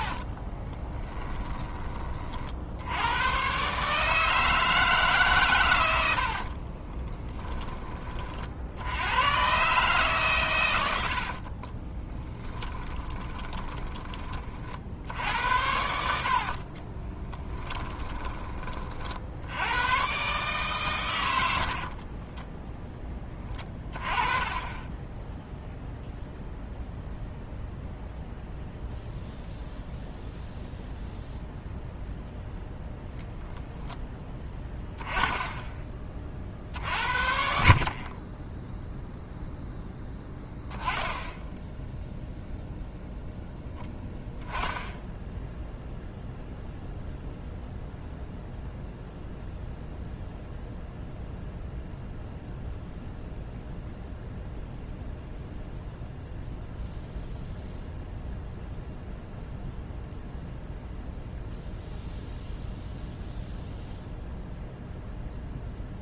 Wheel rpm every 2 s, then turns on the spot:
20, 70, 150, 40, 80, 90, 20, 50, 30, 40, 130, 10, 20, 0, 0, 0, 10, 10, 50, 0, 10, 0, 0, 0, 0, 0, 0, 0, 0, 0, 0, 0, 0.
0-2 6-8 12-14 16-18